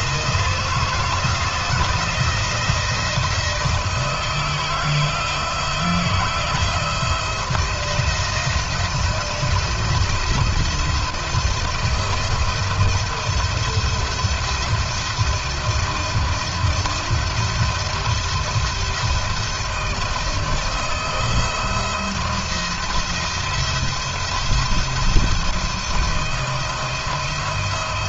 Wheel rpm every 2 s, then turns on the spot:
170, 160, 170, 170, 160, 170, 170, 170, 170, 170, 160, 170, 170, 170.
none